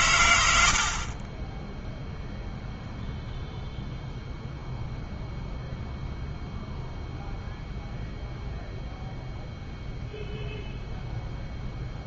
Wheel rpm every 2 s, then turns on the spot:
60, 0, 0, 0, 0, 0.
none